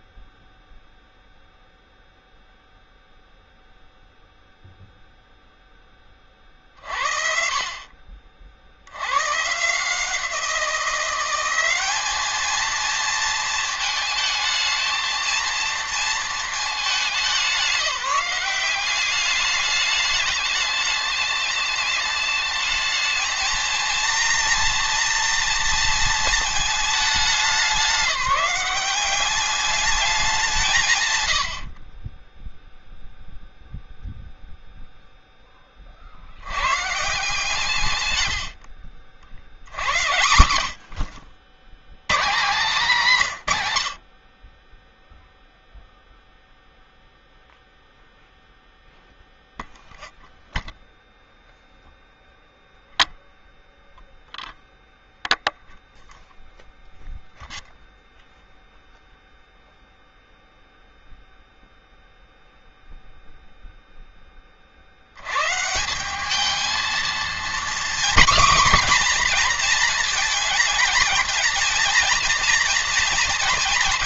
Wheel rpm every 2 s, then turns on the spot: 0, 0, 0, 60, 70, 170, 230, 220, 210, 190, 210, 220, 230, 220, 190, 160, 0, 0, 130, 70, 80, 190, 10, 0, 0, 0, 0, 0, 0, 0, 0, 0, 60, 230, 260, 220, 230.
38-40